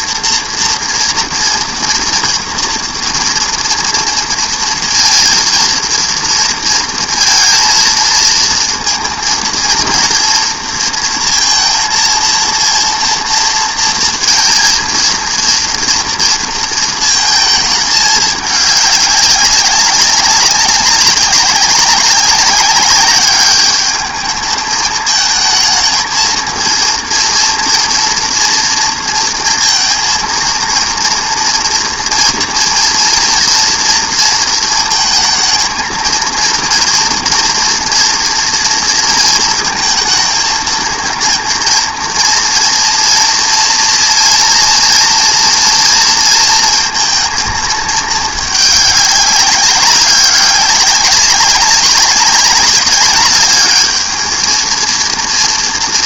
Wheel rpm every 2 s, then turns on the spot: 230, 240, 230, 230, 230, 230, 230, 230, 230, 210, 200, 200, 210, 230, 240, 230, 230, 230, 230, 230, 230, 230, 230, 230, 210, 190, 200, 230.
none